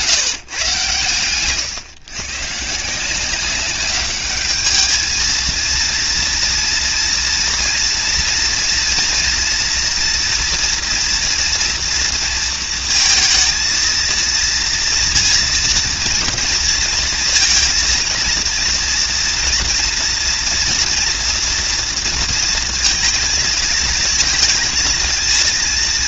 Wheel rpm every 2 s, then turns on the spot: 130, 160, 220, 230, 230, 230, 230, 230, 230, 230, 230, 220, 230.
none